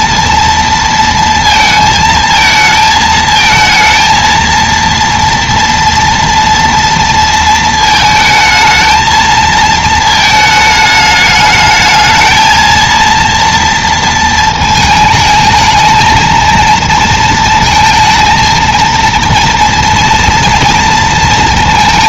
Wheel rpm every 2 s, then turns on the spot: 230, 220, 230, 230, 220, 220, 230, 220, 230, 230, 230.
none